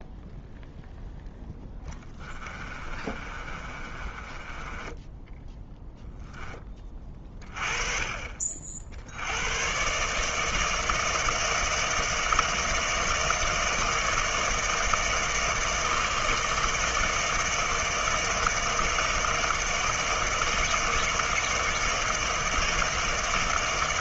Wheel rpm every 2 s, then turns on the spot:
0, 30, 20, 10, 50, 160, 160, 160, 160, 160, 160, 160.
2-6